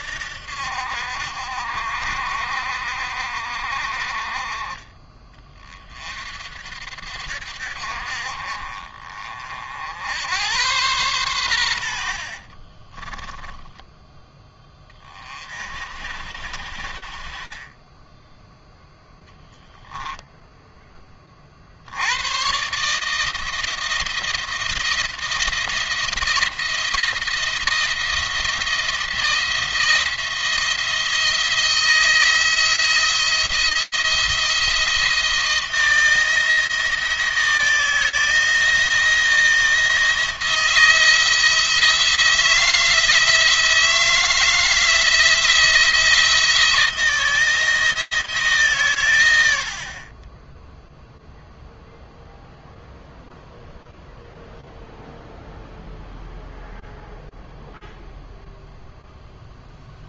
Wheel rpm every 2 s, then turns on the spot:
60, 60, 30, 60, 40, 110, 50, 20, 50, 0, 10, 140, 170, 170, 170, 170, 170, 170, 160, 160, 160, 170, 160, 170, 130, 0, 0, 0, 0, 0.
12-14